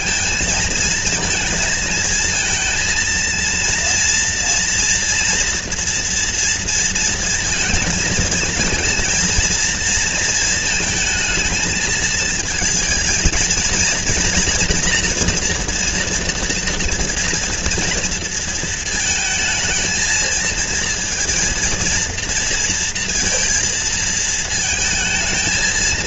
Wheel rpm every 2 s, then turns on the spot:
220, 230, 240, 230, 230, 230, 220, 230, 230, 220, 230, 230, 220.
none